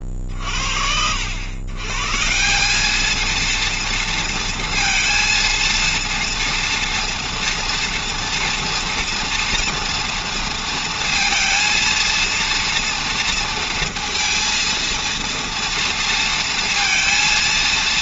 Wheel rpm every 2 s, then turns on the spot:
60, 200, 230, 230, 230, 230, 230, 230, 230.
none